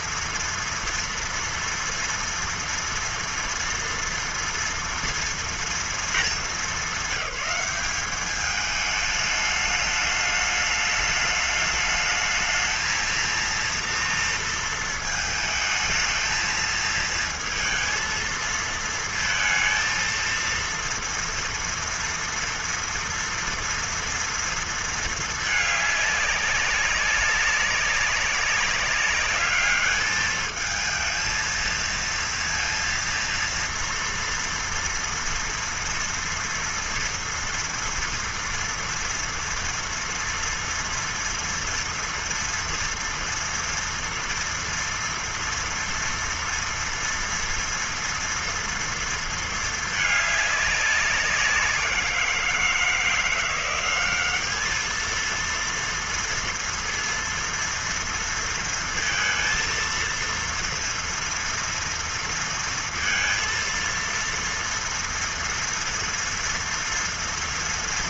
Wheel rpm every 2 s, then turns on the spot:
230, 230, 230, 200, 210, 210, 220, 230, 220, 220, 230, 230, 230, 200, 200, 220, 230, 230, 230, 230, 230, 240, 230, 230, 230, 200, 170, 210, 230, 230, 230, 230, 230, 220.
none